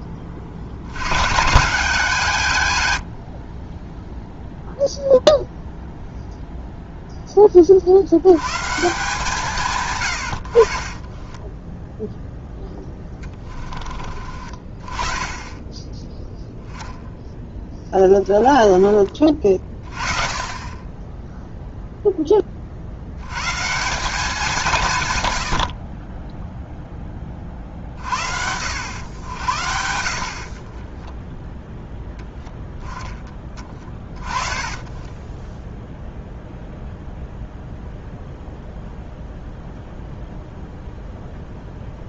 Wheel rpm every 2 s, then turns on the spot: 60, 100, 0, 0, 140, 30, 10, 20, 0, 30, 20, 60, 150, 10, 90, 20, 10, 10, 0, 0, 0.
10-14 18-20 30-32